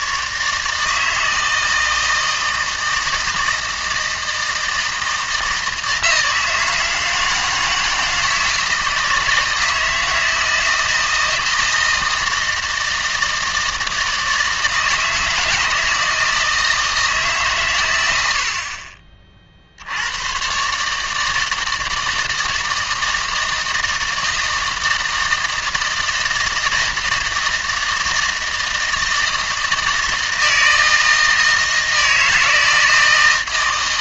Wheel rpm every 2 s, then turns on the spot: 160, 160, 160, 160, 160, 160, 160, 160, 160, 50, 140, 160, 160, 160, 160, 160, 160.
none